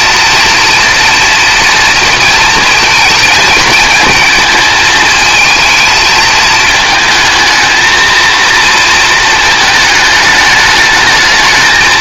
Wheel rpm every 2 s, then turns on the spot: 230, 230, 220, 220, 230, 220.
none